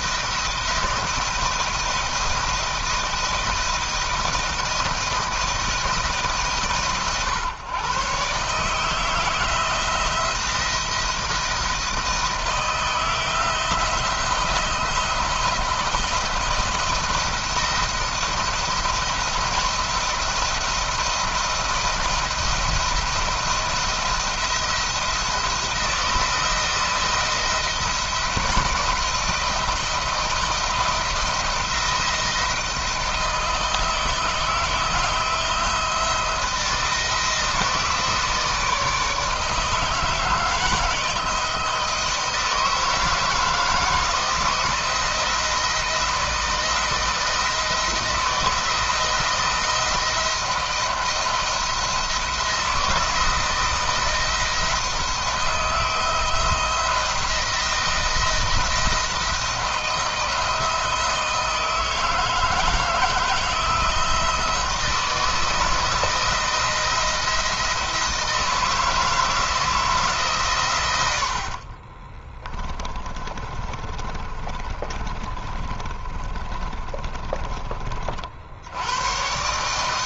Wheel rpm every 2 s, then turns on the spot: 160, 170, 160, 130, 160, 170, 160, 170, 160, 170, 160, 170, 170, 170, 170, 170, 160, 170, 160, 160, 160, 160, 160, 160, 170, 170, 170, 170, 170, 170, 160, 160, 160, 170, 160, 90, 30, 30, 20, 100.
72-78